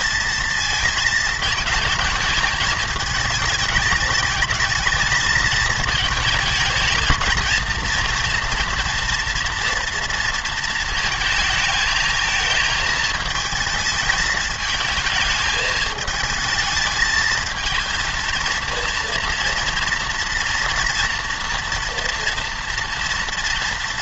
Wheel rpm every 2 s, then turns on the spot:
230, 220, 220, 220, 230, 230, 220, 220, 220, 230, 240, 230.
none